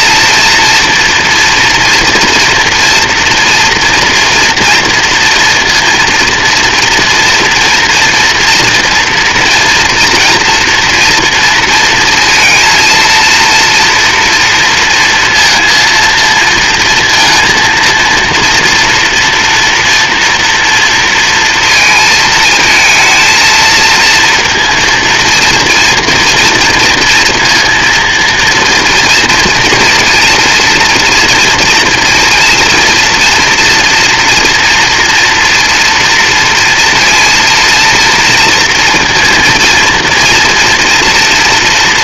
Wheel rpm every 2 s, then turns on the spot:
230, 230, 230, 230, 230, 230, 230, 230, 230, 230, 230, 220, 230, 230, 240, 230, 230, 230, 230, 230, 240.
none